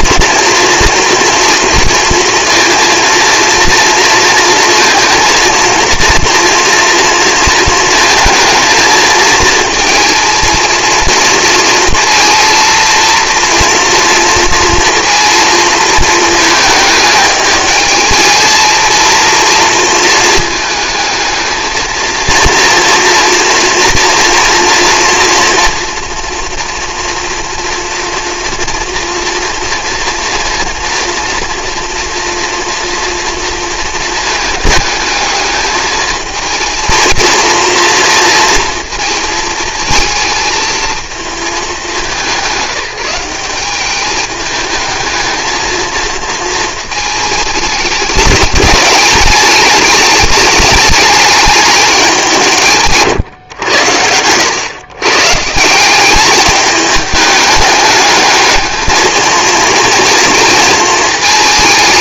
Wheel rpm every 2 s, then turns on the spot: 240, 230, 230, 230, 220, 230, 230, 230, 220, 220, 220, 230, 230, 230, 230, 230, 230, 220, 230, 230, 220, 190, 220, 220, 210, 210, 150, 100, 210, 220, 220.
none